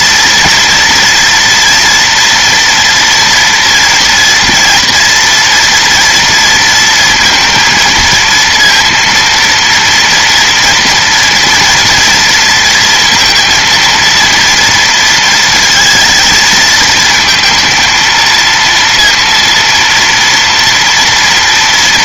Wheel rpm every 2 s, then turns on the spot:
230, 230, 230, 230, 230, 230, 230, 230, 220, 230, 230.
none